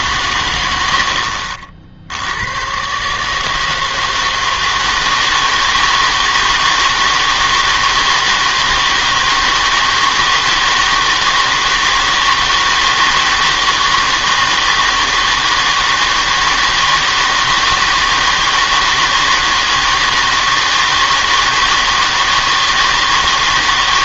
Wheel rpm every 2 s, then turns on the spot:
100, 100, 160, 160, 160, 160, 160, 160, 160, 160, 160, 160.
none